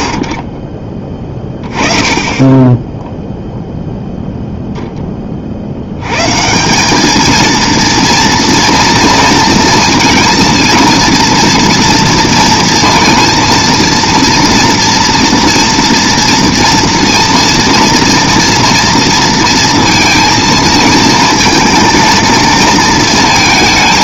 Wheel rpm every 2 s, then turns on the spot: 40, 10, 0, 170, 230, 230, 230, 230, 230, 230, 230, 230.
none